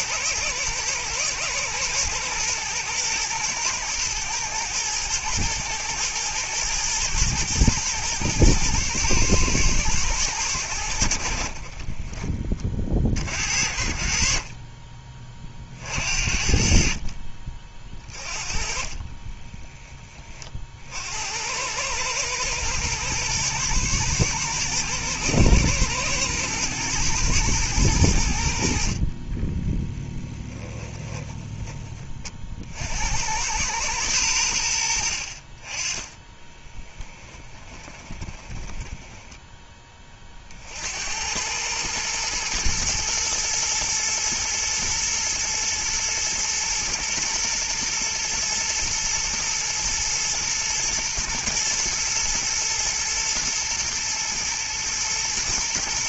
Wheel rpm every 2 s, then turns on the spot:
120, 110, 110, 120, 110, 80, 40, 30, 50, 30, 60, 110, 120, 110, 50, 20, 60, 70, 10, 20, 70, 110, 110, 120, 120, 110, 110, 110.
18-20 28-32 36-40